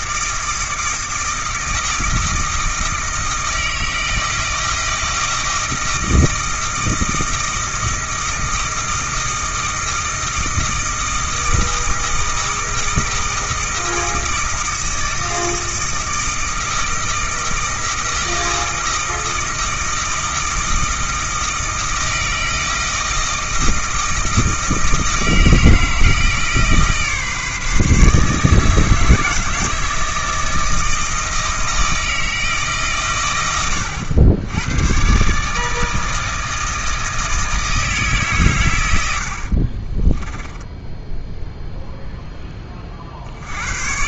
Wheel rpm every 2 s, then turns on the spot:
160, 160, 160, 160, 160, 160, 160, 160, 160, 160, 160, 160, 160, 150, 160, 160, 150, 100, 160, 110, 10, 10.
none